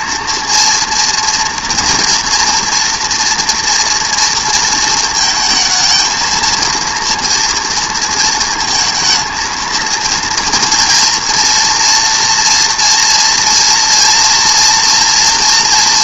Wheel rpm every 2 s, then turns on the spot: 240, 230, 230, 230, 230, 230, 240, 240.
none